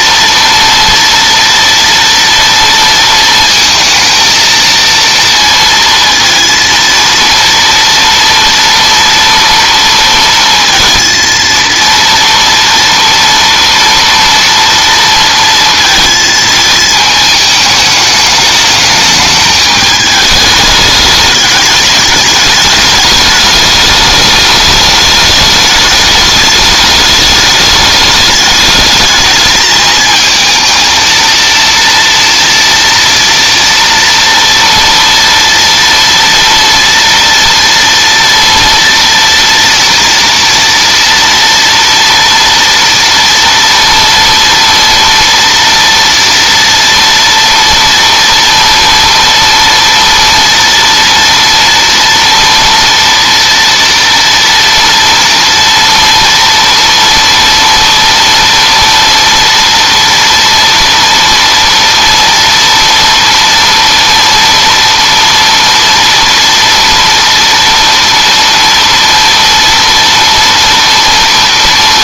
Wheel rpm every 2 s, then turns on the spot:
230, 230, 230, 230, 230, 230, 230, 230, 220, 210, 210, 210, 210, 210, 210, 230, 240, 230, 230, 230, 230, 230, 230, 230, 230, 230, 230, 240, 230, 240, 230, 240, 230, 240, 230, 230.
none